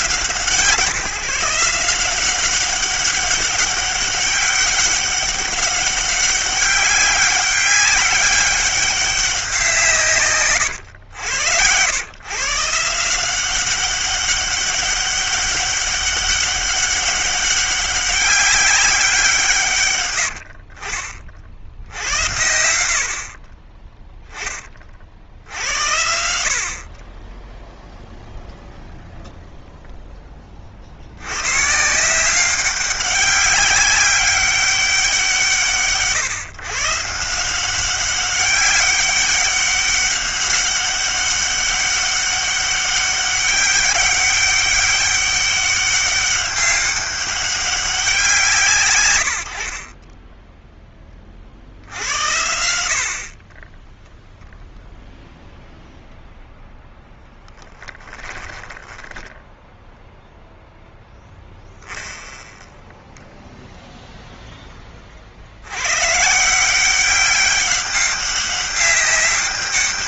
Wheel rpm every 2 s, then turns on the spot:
160, 190, 200, 200, 200, 120, 160, 200, 200, 190, 40, 70, 40, 40, 0, 60, 190, 190, 150, 200, 200, 200, 200, 200, 120, 10, 60, 0, 10, 10, 0, 0, 20, 180, 200.
none